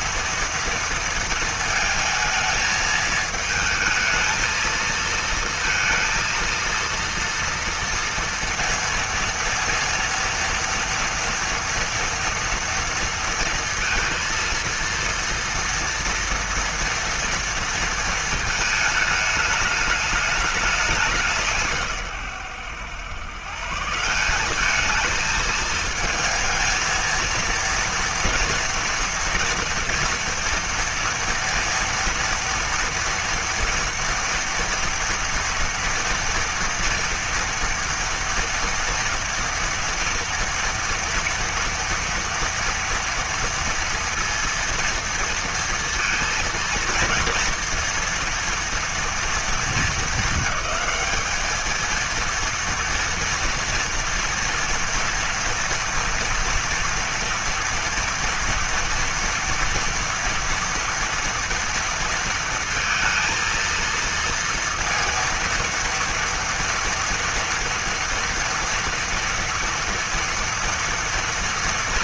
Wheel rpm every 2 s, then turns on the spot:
230, 220, 230, 230, 230, 230, 230, 230, 230, 210, 180, 110, 210, 230, 230, 230, 230, 230, 230, 230, 230, 230, 230, 230, 230, 220, 230, 230, 230, 230, 240, 230, 230, 230, 230, 230.
none